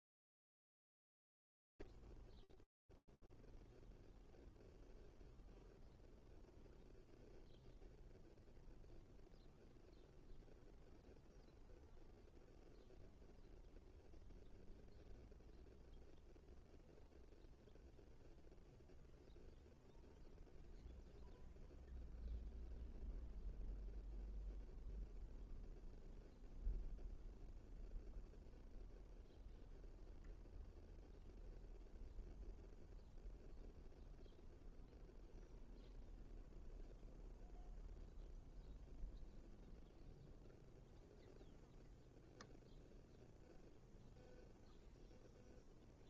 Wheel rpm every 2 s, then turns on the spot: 0, 0, 0, 0, 0, 0, 0, 0, 0, 0, 0, 0, 0, 0, 0, 0, 0, 0, 0, 0, 0, 0, 0.
none